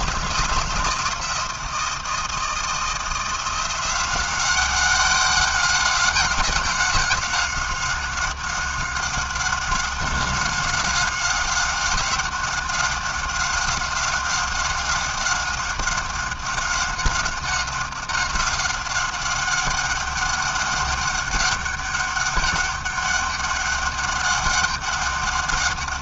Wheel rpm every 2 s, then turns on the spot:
170, 170, 190, 190, 190, 190, 190, 190, 190, 190, 200, 200, 200.
none